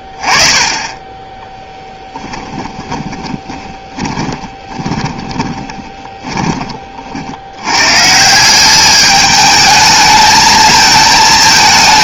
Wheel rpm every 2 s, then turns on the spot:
20, 20, 20, 30, 190, 220.
2-6